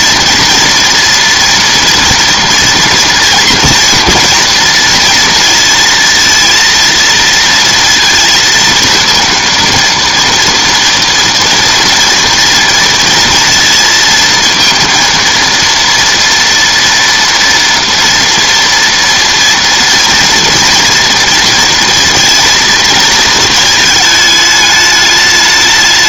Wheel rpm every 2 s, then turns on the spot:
230, 230, 230, 230, 230, 230, 230, 230, 230, 230, 230, 220, 210.
none